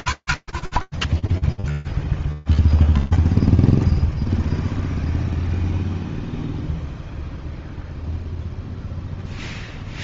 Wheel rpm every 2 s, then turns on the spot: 0, 0, 0, 0, 0.
none